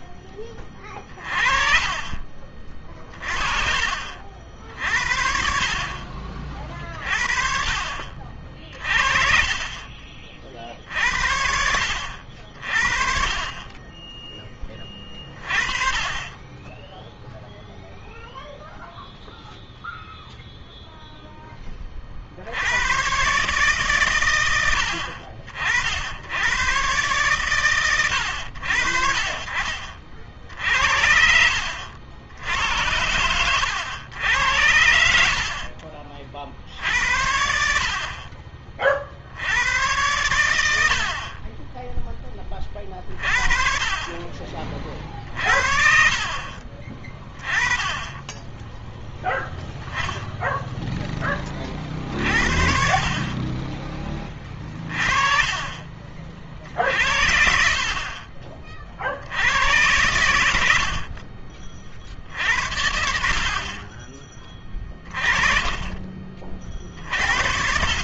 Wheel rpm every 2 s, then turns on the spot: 30, 30, 60, 40, 40, 50, 50, 20, 10, 0, 0, 80, 90, 110, 70, 60, 90, 90, 50, 50, 80, 30, 40, 40, 10, 10, 60, 30, 60, 50, 90, 70, 20, 40.
none